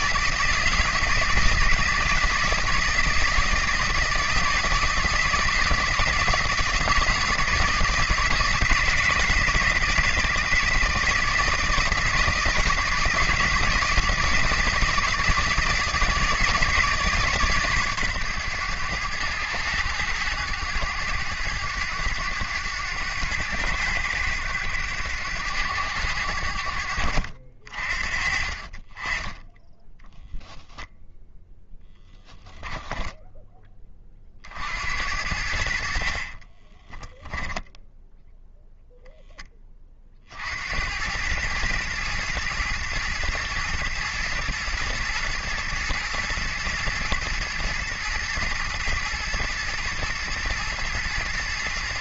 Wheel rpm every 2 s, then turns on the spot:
160, 160, 160, 170, 160, 160, 170, 160, 160, 110, 100, 100, 100, 70, 40, 0, 10, 70, 20, 0, 80, 120, 120, 120, 110, 110.
36-38